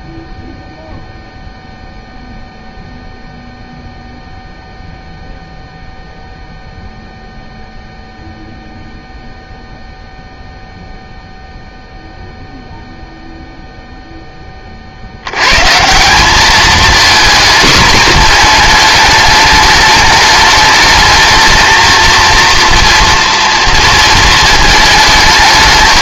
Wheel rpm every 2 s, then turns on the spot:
0, 0, 0, 0, 0, 0, 0, 30, 220, 230, 210, 230, 220.
none